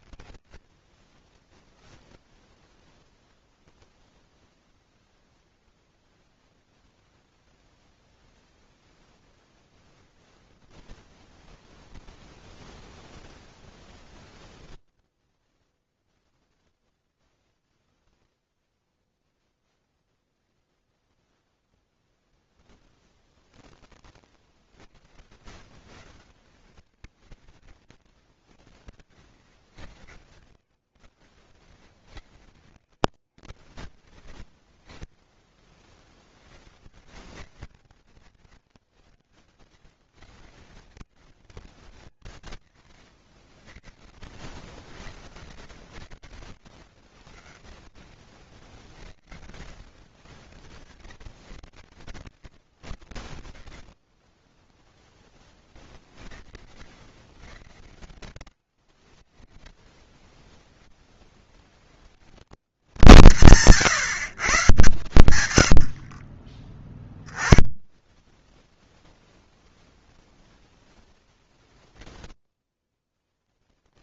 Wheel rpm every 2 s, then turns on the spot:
30, 0, 0, 0, 0, 10, 30, 10, 0, 0, 0, 0, 90, 120, 100, 120, 100, 30, 130, 130, 120, 70, 80, 70, 70, 130, 90, 20, 100, 70, 60, 130, 120, 10, 0, 10, 10.
10-14 46-48 64-66